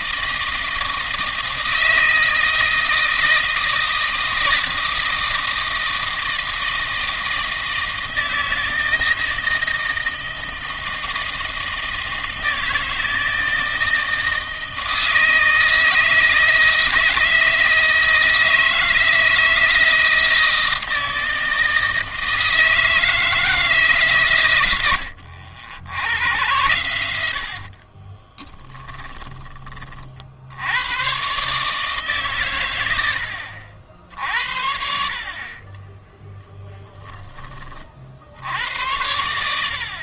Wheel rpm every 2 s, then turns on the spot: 160, 160, 160, 160, 160, 160, 160, 160, 160, 160, 160, 160, 90, 90, 20, 100, 110, 70, 10, 80.
28-30